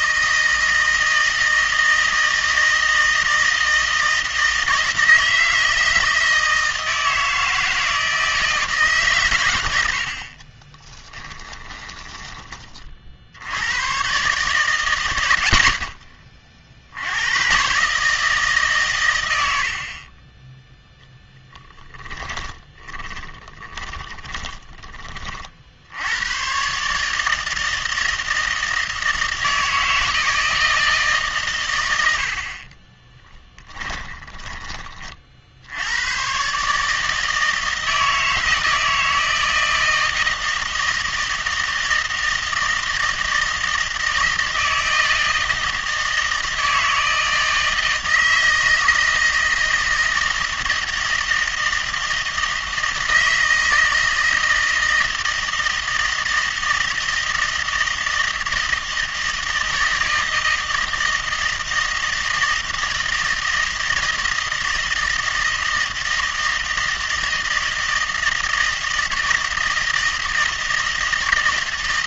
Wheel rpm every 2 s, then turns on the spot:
160, 160, 160, 160, 150, 20, 40, 110, 60, 140, 0, 20, 20, 140, 160, 160, 30, 30, 150, 160, 160, 160, 160, 160, 160, 160, 160, 160, 160, 160, 160, 160, 160, 160, 160, 160.
10-12 22-24 32-34